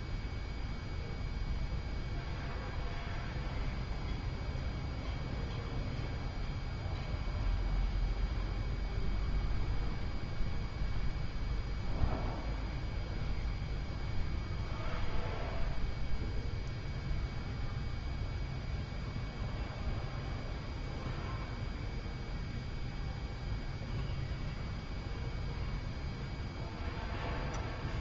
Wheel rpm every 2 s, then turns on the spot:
0, 0, 0, 0, 0, 0, 0, 0, 0, 0, 0, 0, 0, 0.
none